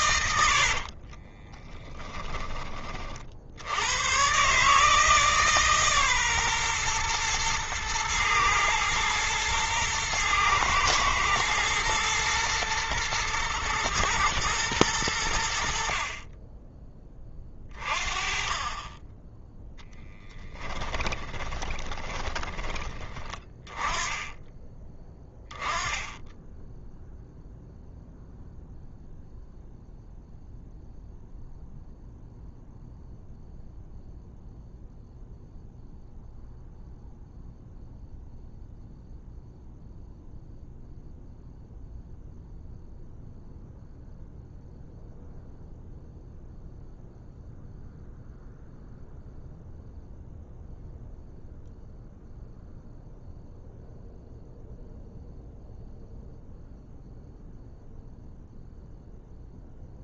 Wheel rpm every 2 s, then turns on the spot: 40, 40, 150, 120, 110, 110, 110, 100, 20, 20, 10, 20, 20, 0, 0, 0, 0, 0, 0, 0, 0, 0, 0, 0, 0, 0, 0, 0, 0, 0.
0-2 20-22